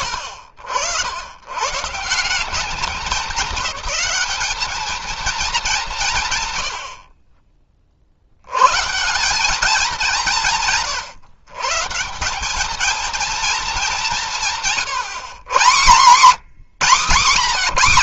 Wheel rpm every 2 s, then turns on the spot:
100, 190, 220, 70, 150, 140, 220, 150, 160.
none